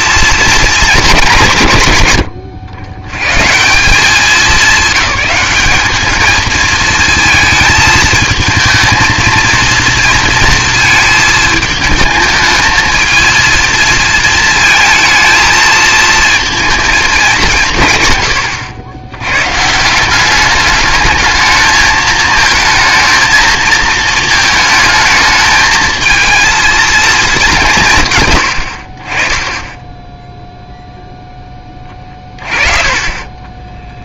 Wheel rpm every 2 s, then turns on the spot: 230, 100, 210, 220, 220, 230, 220, 230, 220, 90, 210, 220, 220, 230, 80, 0, 30.
32-34